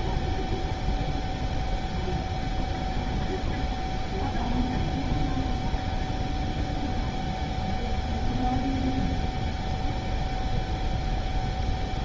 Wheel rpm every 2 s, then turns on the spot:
0, 0, 0, 0, 0, 0.
none